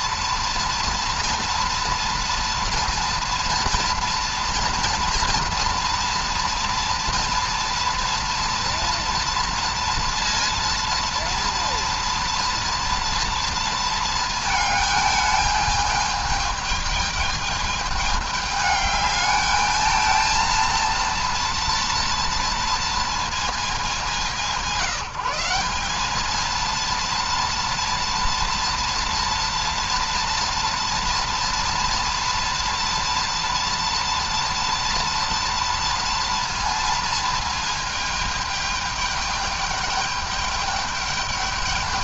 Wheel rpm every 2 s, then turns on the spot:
230, 230, 230, 230, 230, 230, 230, 210, 210, 210, 230, 230, 180, 230, 230, 230, 230, 230, 230, 210, 210.
none